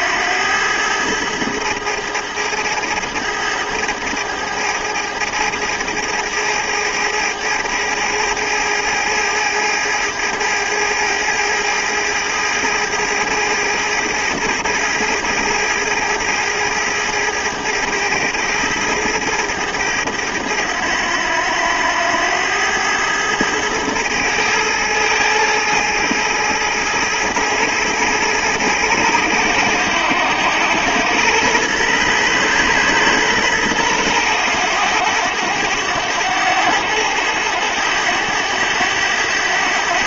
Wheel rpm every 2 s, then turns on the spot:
110, 110, 110, 110, 110, 110, 110, 110, 110, 110, 100, 100, 110, 110, 110, 100, 120, 100, 100, 100.
none